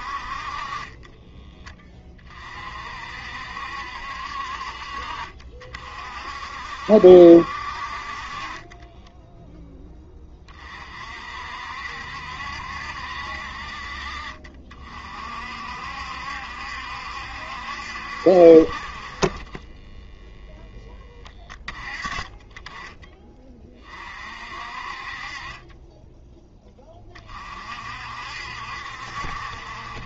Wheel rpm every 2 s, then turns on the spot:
30, 40, 50, 60, 30, 40, 70, 50, 70, 50, 10, 20, 50, 10, 60.
8-10